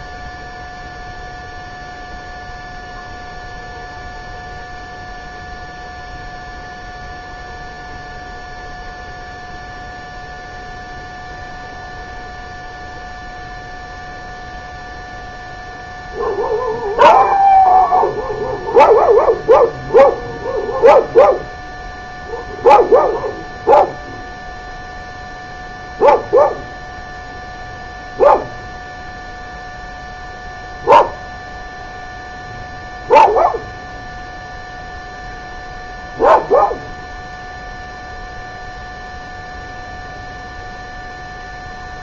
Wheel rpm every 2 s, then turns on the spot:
0, 0, 0, 0, 0, 0, 0, 0, 0, 0, 0, 0, 0, 0, 0, 0, 0, 0, 0, 0, 0.
none